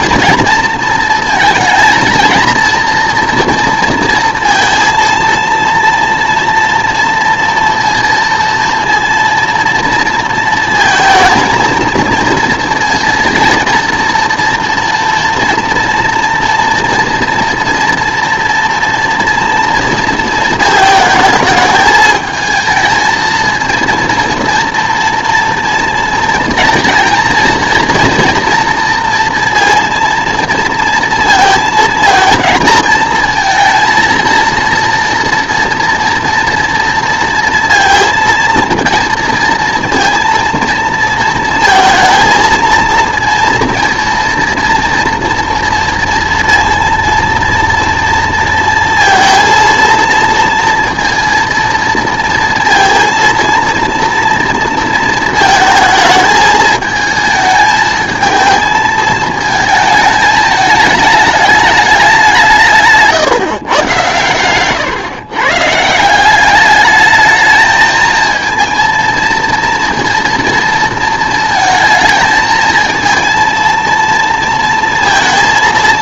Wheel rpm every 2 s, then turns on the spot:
230, 230, 230, 230, 230, 230, 230, 240, 230, 230, 220, 220, 230, 230, 230, 230, 230, 230, 230, 230, 230, 220, 230, 230, 230, 230, 230, 230, 220, 220, 220, 170, 120, 200, 230, 230, 230, 230.
none